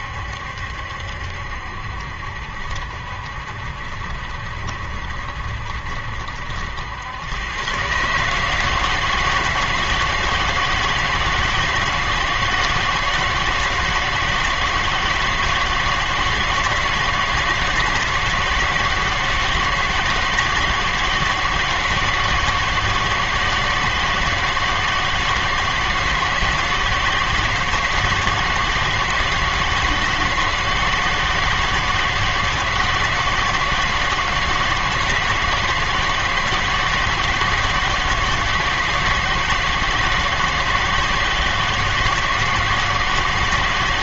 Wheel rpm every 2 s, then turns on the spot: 70, 70, 60, 90, 160, 160, 160, 160, 160, 160, 160, 160, 160, 160, 160, 160, 160, 160, 160, 160, 160, 160.
none